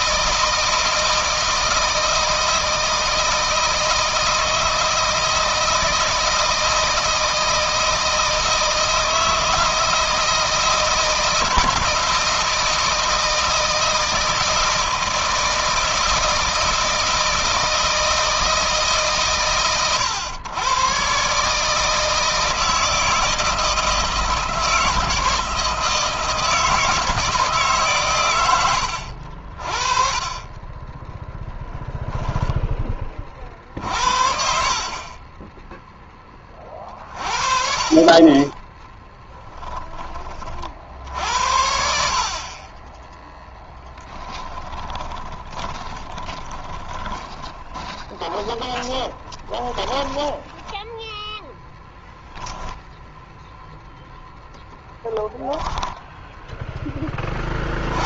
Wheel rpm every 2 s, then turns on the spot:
160, 160, 160, 160, 160, 160, 160, 160, 160, 150, 120, 160, 160, 160, 80, 20, 20, 30, 40, 20, 50, 20, 20, 20, 20, 10, 0, 0, 10.
30-32 38-40 44-50